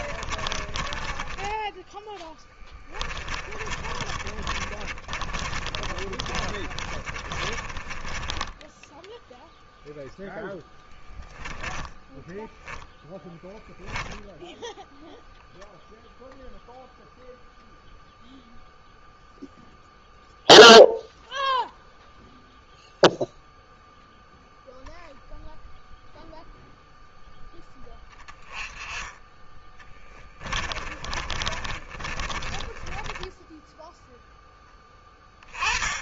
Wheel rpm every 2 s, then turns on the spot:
20, 10, 30, 30, 10, 10, 10, 0, 0, 0, 0, 0, 0, 0, 20, 20, 20, 10.
0-14 30-34